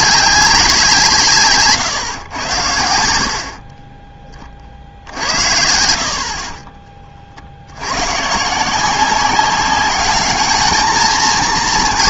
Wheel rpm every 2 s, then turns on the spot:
180, 90, 40, 30, 160, 220.
none